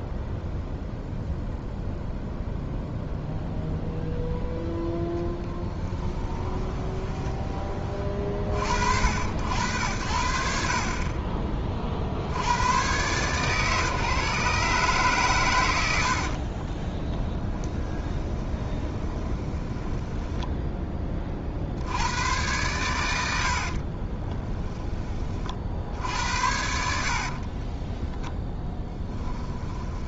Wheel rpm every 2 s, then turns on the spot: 0, 0, 0, 10, 70, 50, 110, 140, 30, 20, 10, 110, 20, 80, 10.
6-8 16-20 26-30